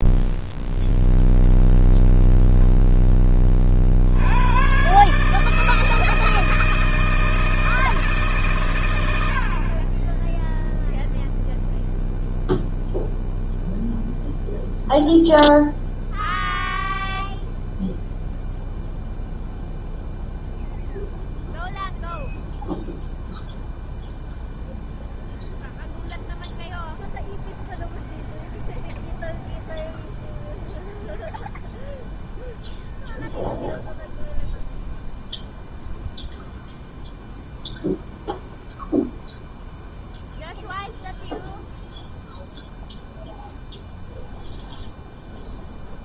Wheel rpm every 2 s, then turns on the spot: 0, 10, 140, 160, 90, 0, 0, 0, 0, 0, 0, 0, 0, 0, 0, 0, 0, 0, 0, 0, 0, 0, 0.
none